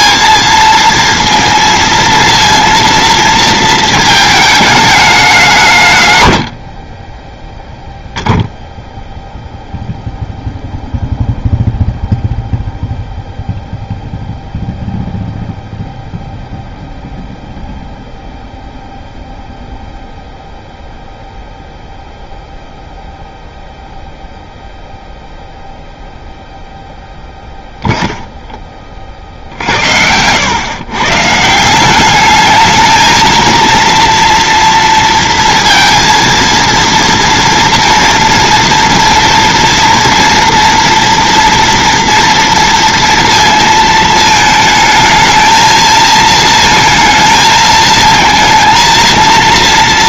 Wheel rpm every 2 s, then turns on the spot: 230, 230, 210, 50, 0, 0, 0, 0, 0, 0, 0, 0, 0, 0, 20, 110, 220, 230, 230, 230, 230, 230, 220, 220, 220.
none